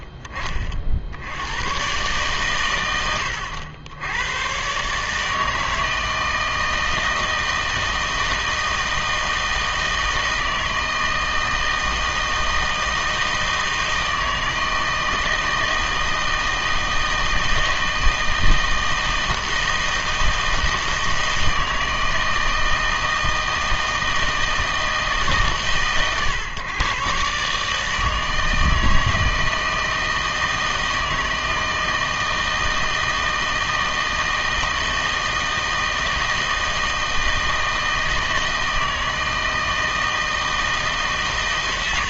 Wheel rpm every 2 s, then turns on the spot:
40, 110, 130, 160, 160, 160, 160, 160, 160, 160, 160, 160, 160, 120, 160, 160, 160, 160, 160, 160, 160.
none